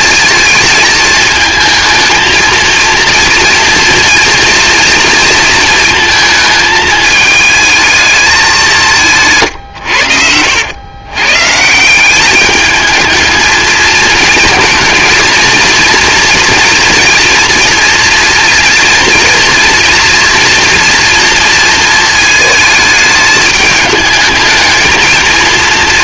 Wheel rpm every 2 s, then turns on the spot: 230, 230, 230, 220, 200, 90, 210, 230, 230, 230, 230, 220, 220.
none